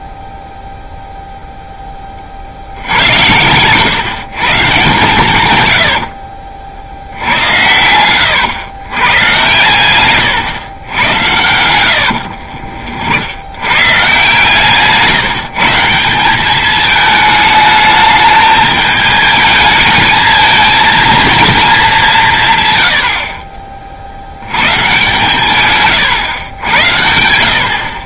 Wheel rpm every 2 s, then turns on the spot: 0, 70, 130, 60, 110, 110, 70, 150, 200, 210, 220, 100, 120, 100.
12-14